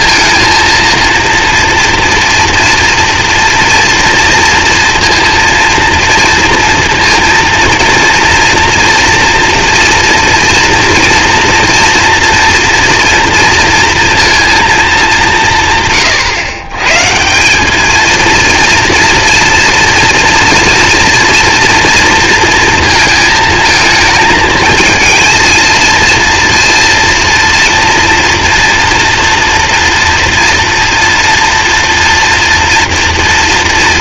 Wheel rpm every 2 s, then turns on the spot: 230, 230, 230, 230, 230, 230, 230, 230, 140, 230, 240, 230, 220, 230, 230, 230, 230.
none